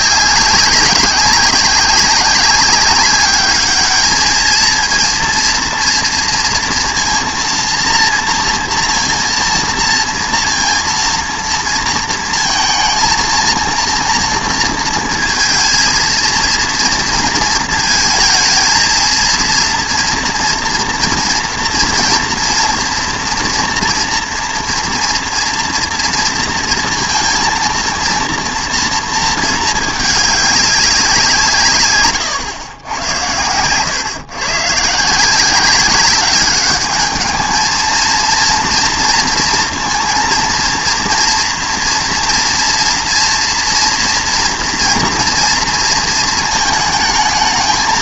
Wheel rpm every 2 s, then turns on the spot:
200, 200, 220, 230, 230, 230, 230, 230, 230, 230, 240, 230, 230, 230, 230, 200, 110, 130, 210, 230, 230, 230, 230, 220.
none